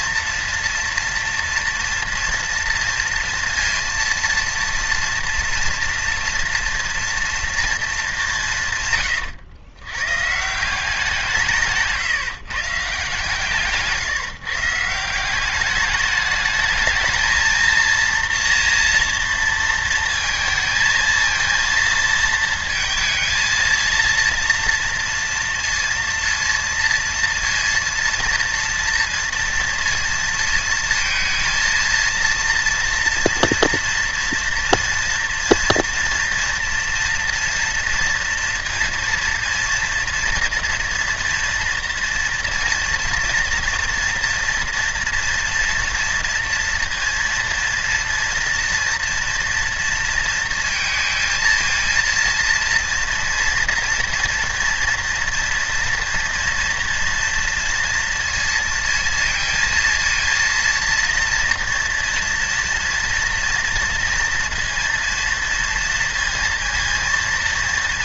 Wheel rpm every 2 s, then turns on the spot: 230, 230, 230, 230, 150, 170, 140, 160, 220, 230, 230, 220, 230, 230, 230, 230, 230, 230, 230, 230, 230, 240, 230, 230, 240, 230, 230, 240, 230, 230, 230, 230, 230, 230.
none